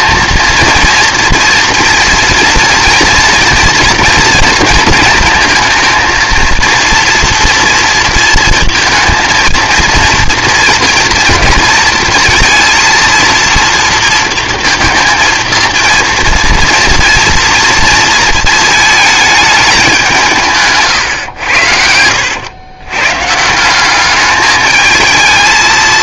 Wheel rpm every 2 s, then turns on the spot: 230, 230, 230, 230, 220, 230, 230, 230, 230, 220, 160, 110, 210.
none